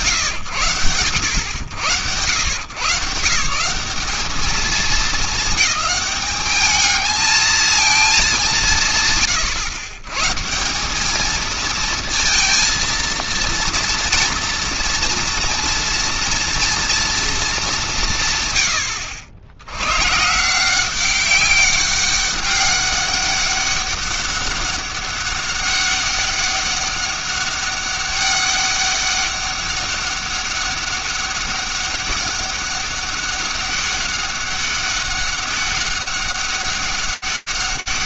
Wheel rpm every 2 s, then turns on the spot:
90, 190, 220, 220, 110, 220, 230, 230, 190, 100, 200, 200, 200, 200, 200, 200, 200, 200, 180.
none